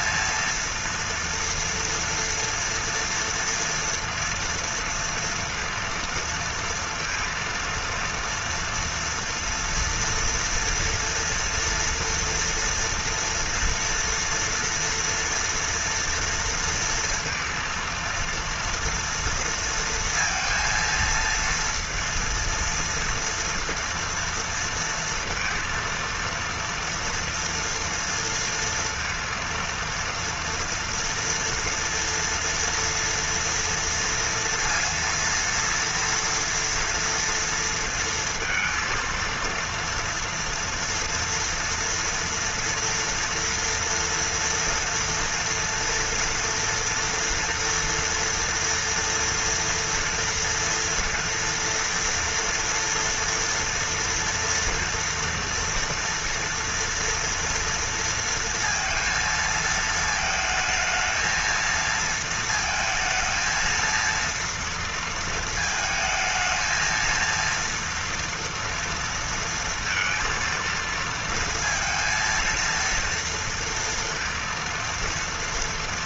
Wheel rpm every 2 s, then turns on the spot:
230, 230, 230, 230, 230, 230, 230, 230, 230, 230, 230, 230, 230, 230, 230, 230, 230, 230, 240, 230, 230, 230, 230, 240, 230, 240, 240, 230, 230, 230, 220, 220, 230, 220, 230, 230, 230, 230.
none